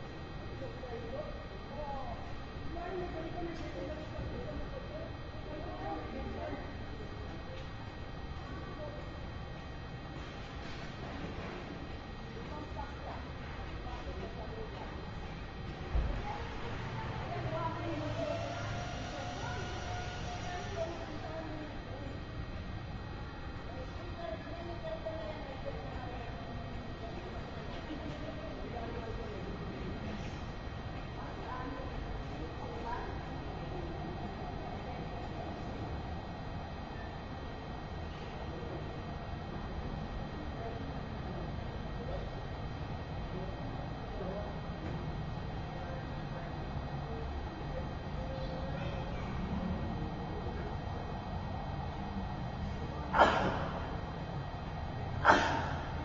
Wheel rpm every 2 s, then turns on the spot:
0, 0, 0, 0, 0, 0, 0, 0, 0, 0, 0, 0, 0, 0, 0, 0, 0, 0, 0, 0, 0, 0, 0, 0, 0, 0, 0, 0.
none